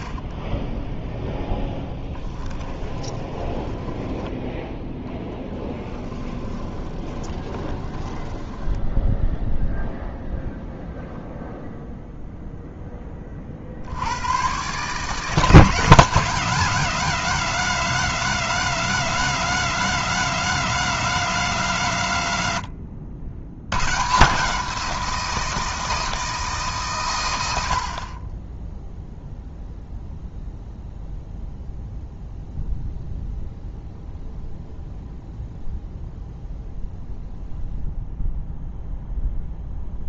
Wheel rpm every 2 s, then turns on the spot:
10, 20, 10, 20, 10, 0, 10, 140, 180, 180, 180, 90, 170, 140, 10, 0, 0, 0, 0, 0.
2-4 6-10